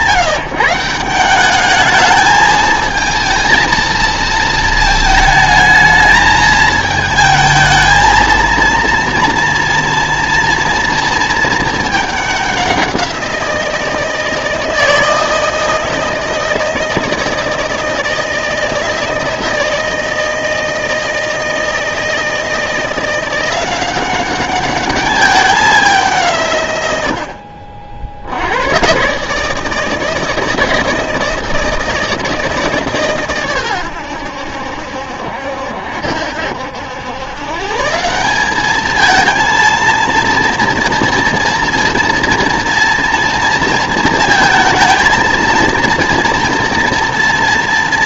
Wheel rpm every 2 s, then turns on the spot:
180, 220, 220, 220, 230, 230, 190, 160, 160, 160, 160, 160, 200, 130, 100, 160, 150, 70, 80, 210, 230, 230, 230, 230.
none